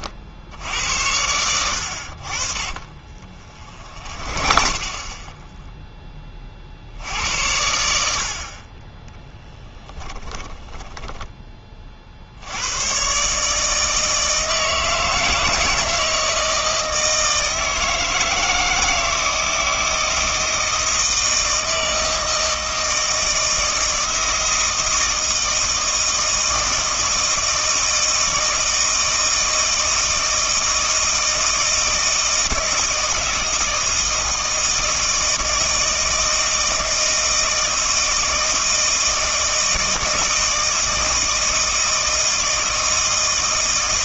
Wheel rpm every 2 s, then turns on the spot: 80, 40, 30, 60, 40, 20, 100, 160, 160, 160, 160, 160, 160, 160, 160, 160, 160, 160, 160, 160, 160, 160.
2-6 10-12